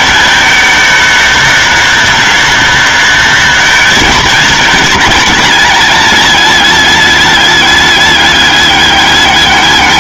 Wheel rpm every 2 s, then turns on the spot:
220, 210, 230, 220, 200.
none